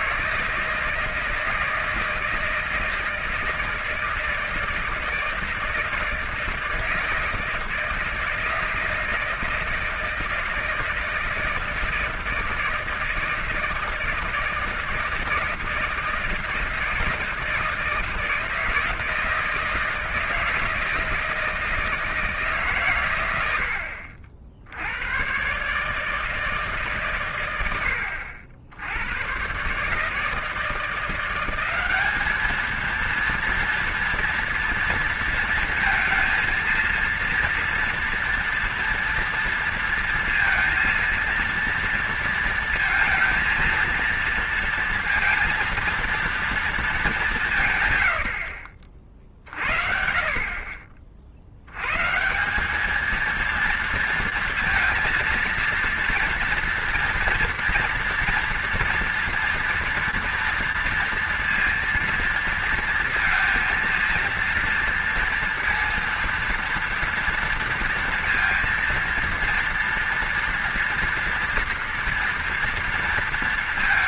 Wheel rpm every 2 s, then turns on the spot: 160, 160, 160, 160, 160, 160, 160, 160, 160, 160, 160, 140, 80, 150, 90, 170, 220, 230, 230, 230, 230, 230, 230, 220, 50, 40, 190, 230, 230, 230, 230, 230, 230, 230, 230, 230, 230.
none